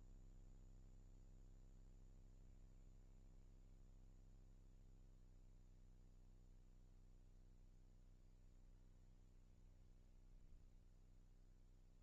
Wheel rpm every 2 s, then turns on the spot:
0, 20, 0, 0, 30, 10.
2-4 8-12